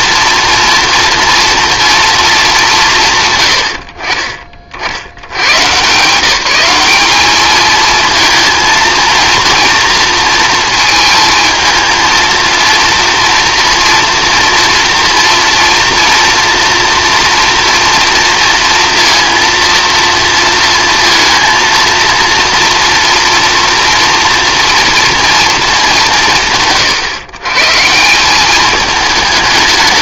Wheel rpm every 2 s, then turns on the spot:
240, 180, 60, 200, 230, 230, 230, 230, 230, 230, 230, 230, 230, 120, 210.
none